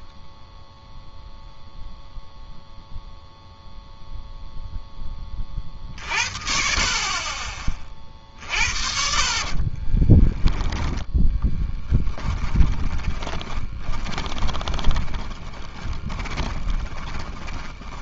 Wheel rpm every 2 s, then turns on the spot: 0, 0, 40, 30, 30, 10, 20, 30, 10.
8-18